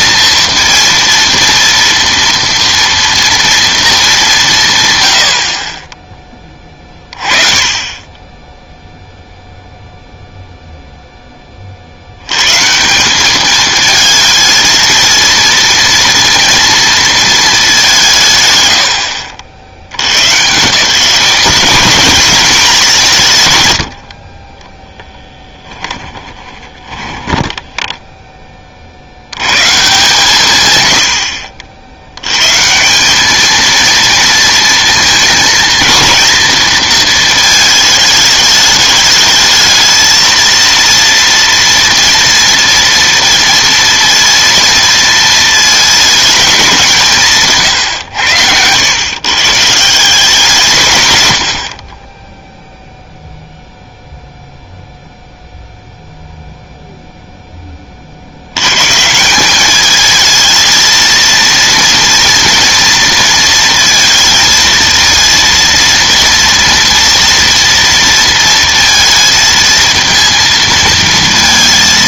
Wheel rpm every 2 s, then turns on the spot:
230, 230, 160, 20, 0, 0, 140, 220, 230, 120, 130, 190, 20, 20, 30, 130, 130, 230, 230, 210, 230, 230, 230, 210, 100, 170, 0, 0, 0, 100, 220, 230, 230, 230, 230, 230.
26-28